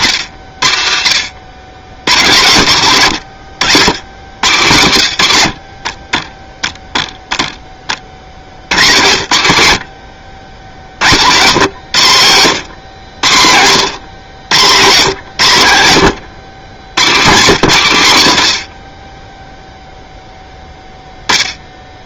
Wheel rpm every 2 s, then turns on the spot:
50, 120, 80, 0, 80, 80, 70, 120, 110, 30, 0.
none